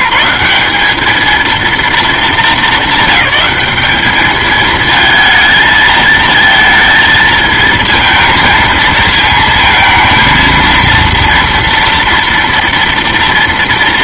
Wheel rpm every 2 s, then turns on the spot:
190, 220, 210, 220, 230, 230, 230.
none